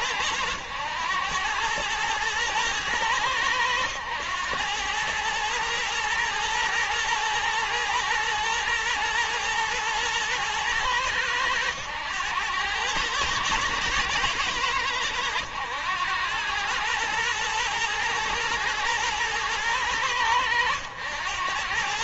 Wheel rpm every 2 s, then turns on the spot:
100, 110, 100, 110, 120, 110, 100, 100, 100, 110, 100.
none